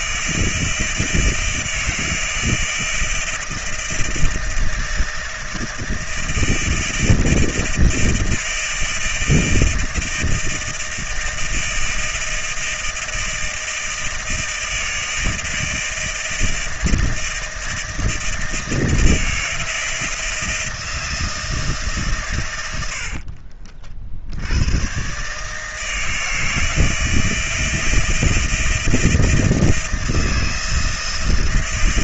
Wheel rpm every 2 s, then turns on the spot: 160, 160, 160, 160, 160, 160, 160, 160, 160, 160, 160, 140, 60, 160, 160, 160.
none